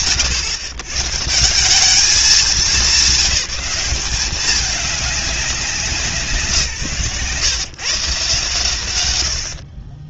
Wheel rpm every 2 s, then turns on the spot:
140, 200, 200, 140, 110.
none